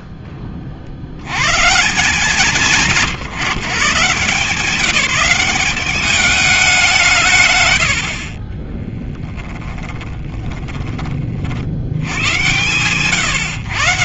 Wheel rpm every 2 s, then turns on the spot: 20, 150, 170, 200, 20, 10, 110.
8-12